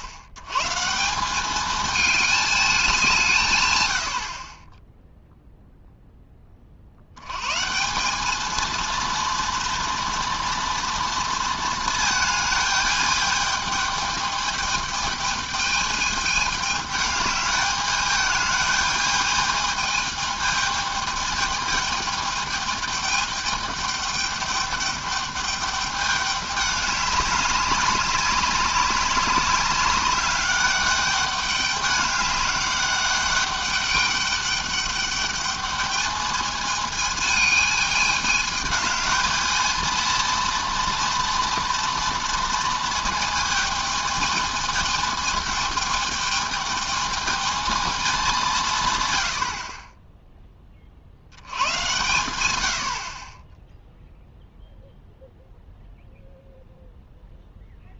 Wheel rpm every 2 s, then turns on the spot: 100, 210, 30, 40, 220, 230, 220, 210, 210, 220, 210, 210, 210, 200, 200, 200, 200, 200, 210, 210, 230, 230, 220, 220, 150, 20, 100, 0, 0.
none